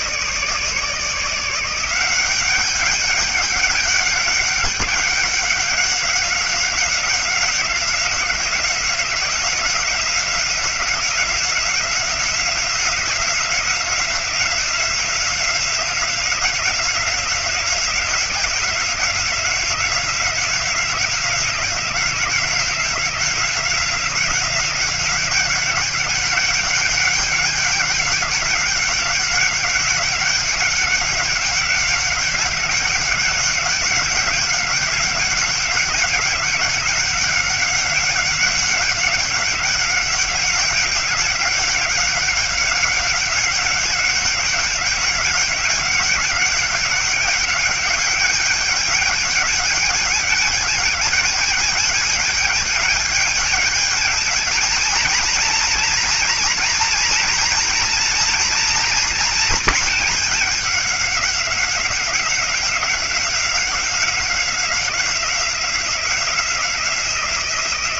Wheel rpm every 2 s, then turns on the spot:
160, 190, 200, 190, 180, 180, 180, 180, 180, 180, 190, 180, 180, 200, 200, 200, 190, 190, 190, 190, 190, 190, 190, 190, 200, 210, 210, 220, 230, 240, 210, 190, 180, 170.
none